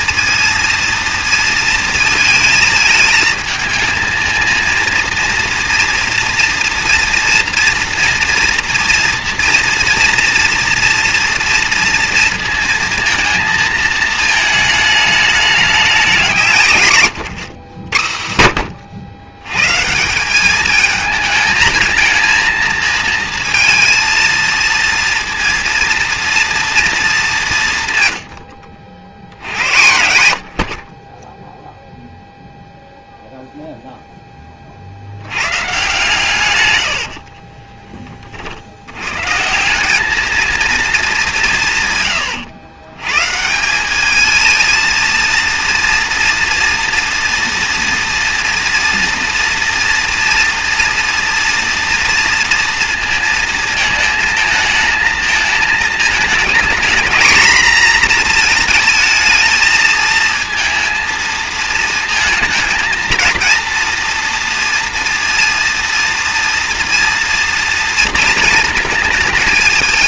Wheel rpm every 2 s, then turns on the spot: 230, 220, 220, 230, 230, 230, 220, 220, 160, 90, 210, 230, 230, 230, 80, 60, 0, 30, 140, 50, 220, 120, 220, 230, 230, 230, 230, 220, 230, 230, 220, 220, 230, 230, 230.
none